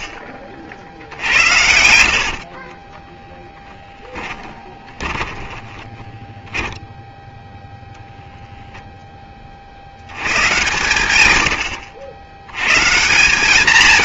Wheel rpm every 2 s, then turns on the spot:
40, 60, 20, 10, 10, 110, 160.
2-8